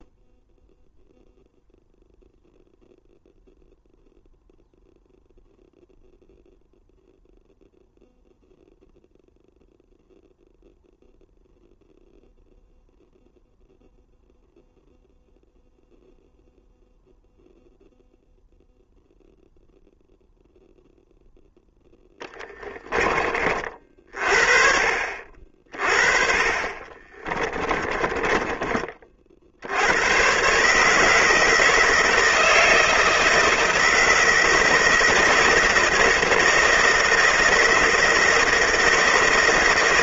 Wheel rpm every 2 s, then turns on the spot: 0, 0, 0, 0, 0, 0, 0, 0, 0, 0, 0, 20, 40, 30, 40, 150, 160, 160, 160, 160.
26-28